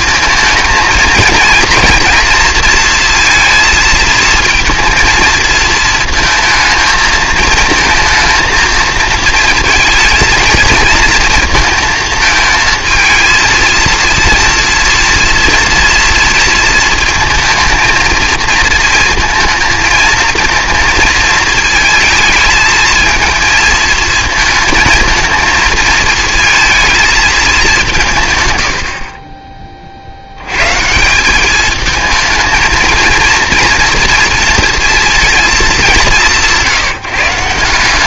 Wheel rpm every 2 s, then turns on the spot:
230, 230, 230, 230, 220, 230, 220, 230, 230, 230, 230, 220, 230, 220, 90, 140, 220, 230, 150.
none